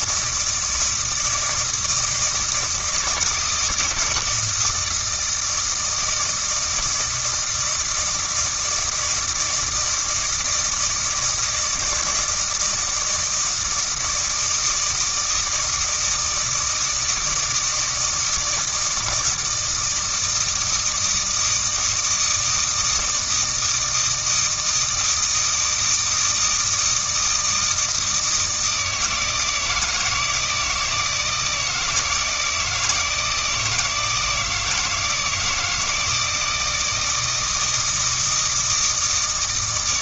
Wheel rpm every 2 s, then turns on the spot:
160, 160, 160, 160, 160, 160, 160, 160, 160, 160, 160, 160, 160, 160, 160, 160, 160, 170, 160, 160.
none